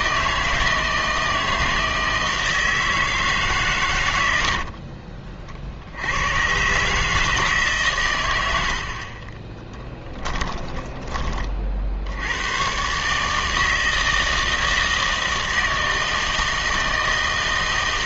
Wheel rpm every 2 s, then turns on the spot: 160, 160, 70, 130, 80, 20, 110, 160, 160.
8-12